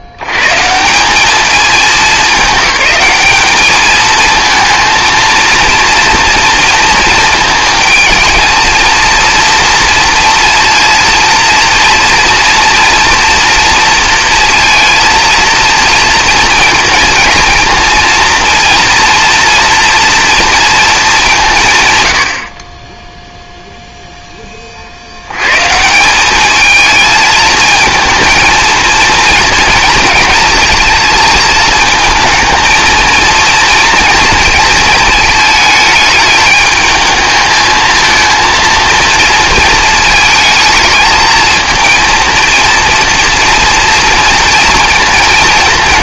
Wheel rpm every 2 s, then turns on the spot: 150, 200, 230, 230, 230, 230, 230, 230, 230, 230, 220, 40, 30, 220, 230, 220, 220, 220, 220, 230, 220, 230, 230.
none